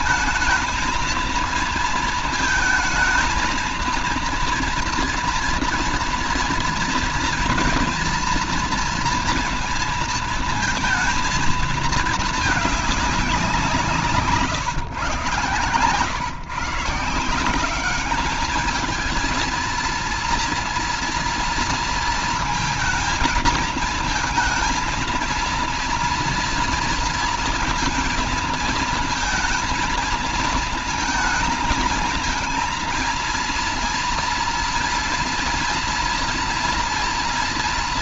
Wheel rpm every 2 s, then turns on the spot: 220, 230, 230, 230, 230, 230, 200, 130, 160, 220, 240, 220, 230, 230, 230, 220, 230, 230, 230.
none